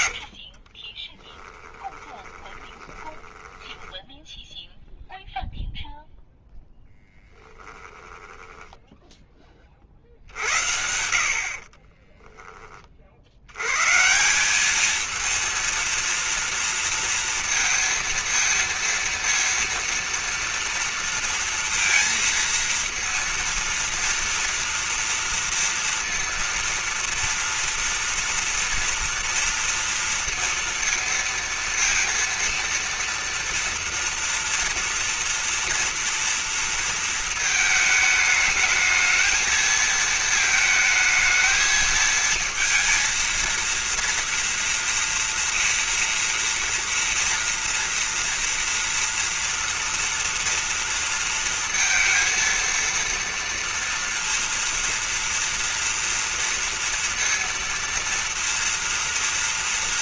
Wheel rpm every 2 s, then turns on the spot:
60, 20, 0, 0, 10, 90, 20, 190, 230, 230, 230, 230, 230, 230, 230, 230, 230, 240, 230, 220, 220, 230, 230, 230, 230, 230, 230, 230, 230, 230.
0-4 8-10